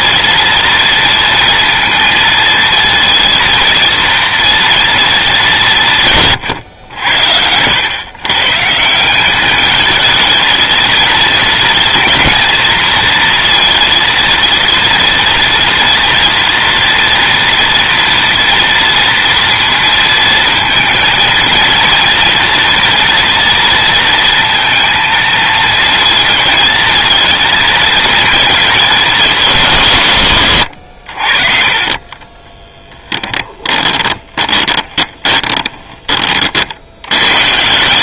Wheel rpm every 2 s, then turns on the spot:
230, 230, 230, 100, 170, 220, 240, 230, 230, 230, 220, 230, 230, 220, 220, 100, 20, 20, 60.
30-36